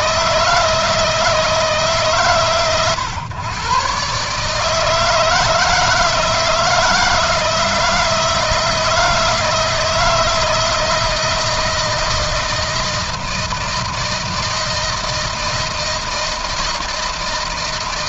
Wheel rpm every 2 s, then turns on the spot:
160, 120, 150, 160, 160, 160, 160, 160, 160.
none